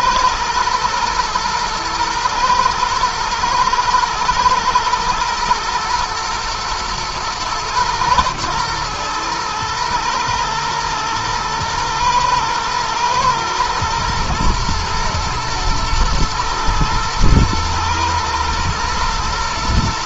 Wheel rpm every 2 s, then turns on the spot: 120, 120, 110, 120, 110, 110, 110, 120, 110, 120.
none